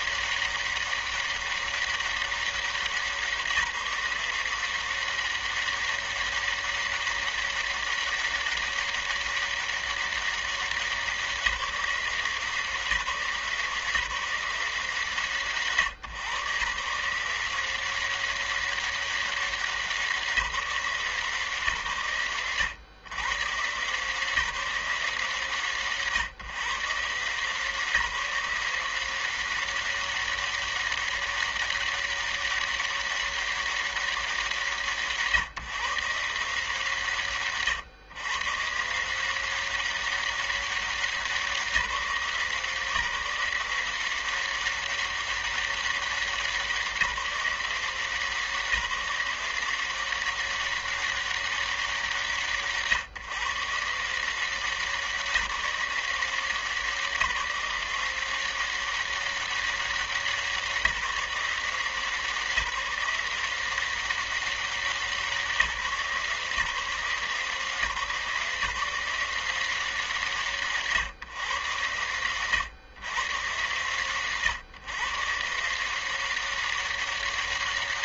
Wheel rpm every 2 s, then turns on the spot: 200, 200, 180, 200, 200, 200, 180, 160, 120, 190, 190, 120, 150, 130, 170, 200, 200, 190, 140, 120, 190, 170, 180, 190, 180, 190, 160, 160, 170, 180, 180, 160, 180, 150, 170, 160, 110, 120, 180.
none